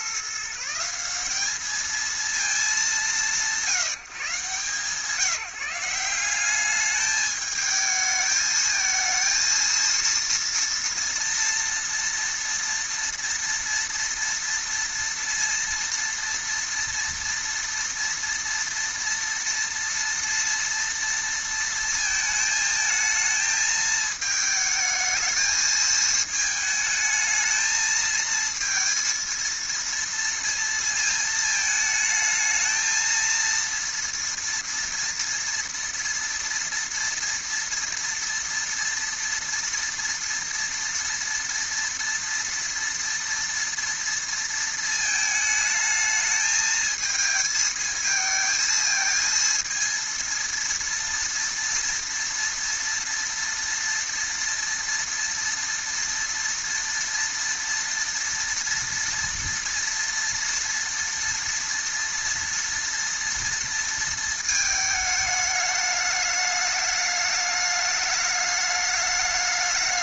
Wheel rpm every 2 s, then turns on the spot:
150, 200, 160, 190, 220, 230, 230, 230, 230, 230, 230, 220, 220, 220, 220, 230, 220, 230, 230, 230, 230, 230, 230, 220, 220, 230, 230, 230, 230, 230, 230, 230, 220, 210, 210.
none